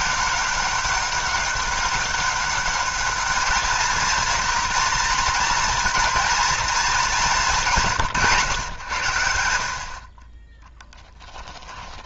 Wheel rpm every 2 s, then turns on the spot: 200, 200, 230, 230, 130, 10.
10-12